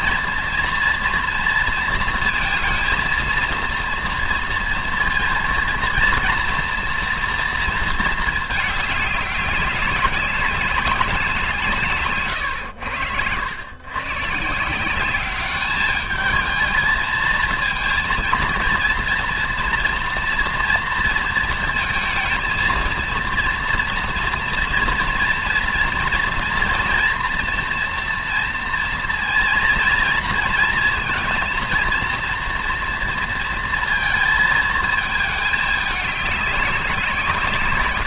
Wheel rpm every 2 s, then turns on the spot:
230, 230, 230, 230, 210, 190, 90, 190, 220, 230, 230, 230, 230, 240, 230, 230, 230, 220, 180.
none